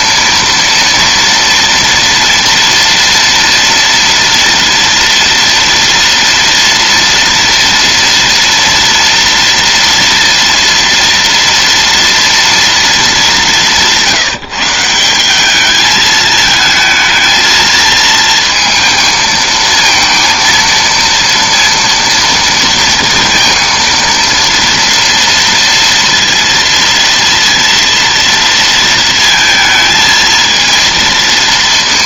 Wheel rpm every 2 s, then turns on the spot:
230, 230, 230, 230, 230, 230, 210, 180, 220, 220, 230, 230, 230, 230, 230, 230.
none